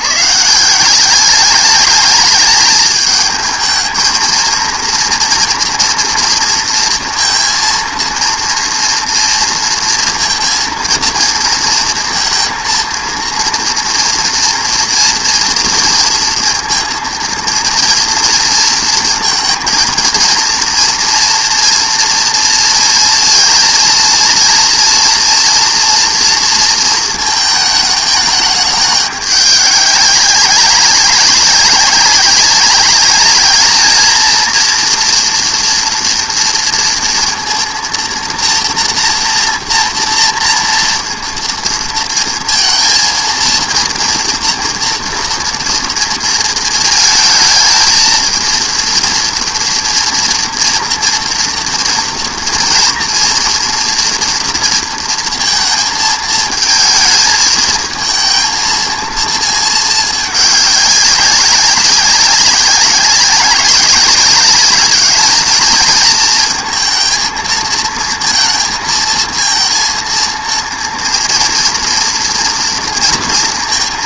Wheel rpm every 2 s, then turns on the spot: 160, 220, 230, 230, 230, 230, 230, 240, 230, 230, 230, 230, 230, 230, 210, 190, 200, 230, 230, 230, 230, 230, 230, 220, 230, 230, 240, 230, 220, 220, 200, 190, 200, 220, 230, 230, 230.
none